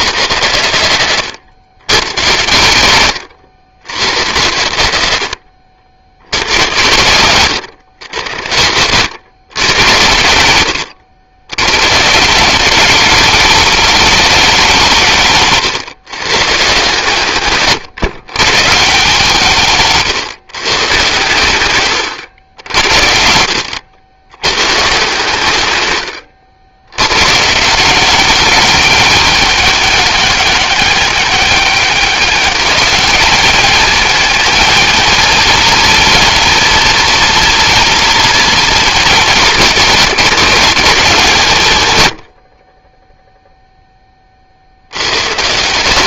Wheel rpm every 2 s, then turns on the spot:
110, 100, 90, 100, 90, 100, 180, 190, 140, 140, 130, 90, 120, 70, 210, 200, 210, 220, 230, 220, 190, 60, 50.
none